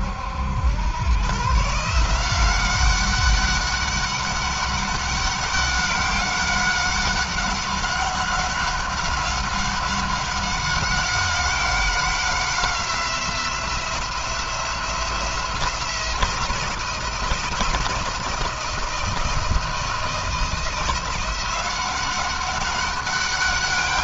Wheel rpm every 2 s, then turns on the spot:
100, 190, 200, 190, 190, 190, 180, 170, 170, 170, 170, 200.
none